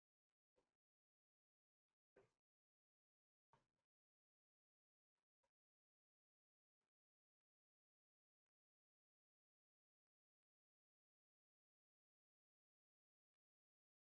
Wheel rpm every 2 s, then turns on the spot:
0, 0, 0, 0, 0, 0, 0.
none